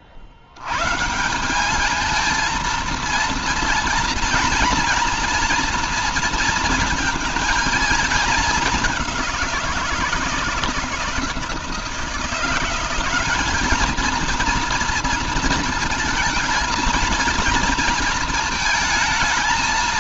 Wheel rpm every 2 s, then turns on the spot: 80, 230, 230, 230, 210, 170, 170, 230, 230, 230.
none